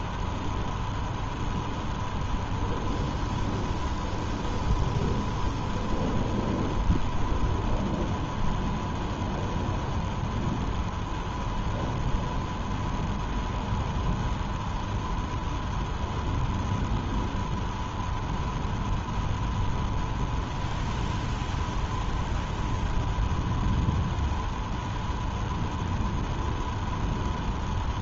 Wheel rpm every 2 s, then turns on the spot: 0, 0, 0, 0, 0, 0, 0, 0, 0, 0, 0, 0, 0, 0.
none